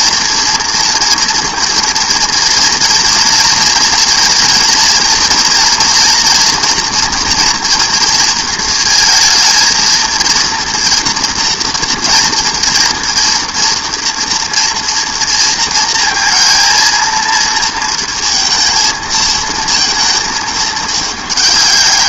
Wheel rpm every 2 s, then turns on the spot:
230, 230, 240, 230, 230, 230, 230, 230, 230, 230, 210.
none